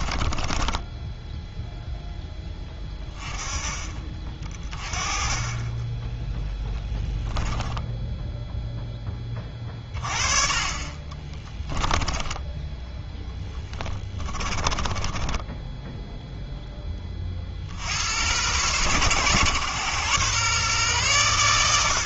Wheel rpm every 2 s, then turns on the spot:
10, 20, 30, 10, 10, 30, 10, 20, 20, 110, 120.
0-2 6-8 10-12 14-16